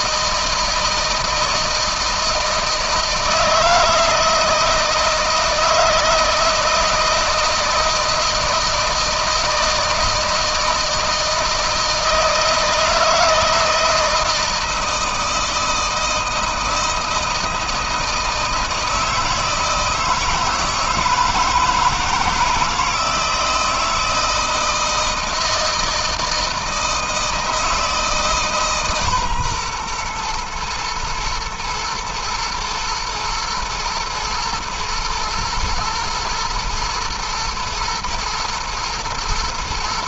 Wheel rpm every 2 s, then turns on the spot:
160, 160, 160, 160, 160, 160, 160, 160, 160, 160, 160, 160, 160, 160, 140, 120, 110, 110, 110, 120.
none